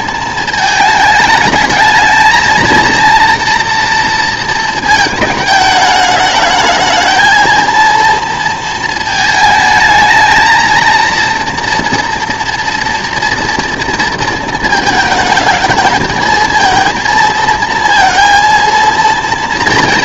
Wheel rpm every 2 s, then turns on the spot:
220, 220, 220, 210, 230, 220, 230, 220, 220, 230.
none